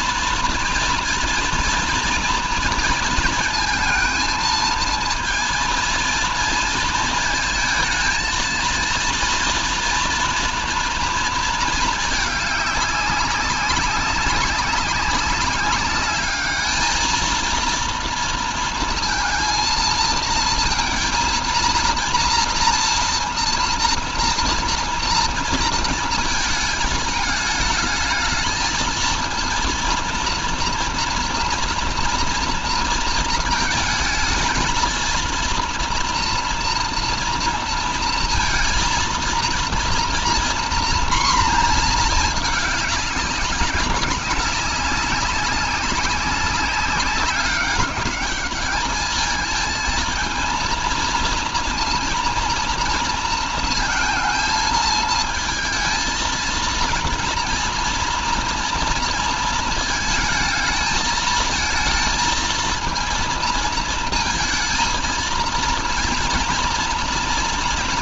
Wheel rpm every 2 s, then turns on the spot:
240, 230, 220, 230, 230, 230, 210, 200, 210, 230, 230, 230, 240, 220, 220, 230, 230, 220, 230, 230, 240, 210, 200, 200, 210, 220, 230, 220, 230, 230, 220, 230, 220, 230.
none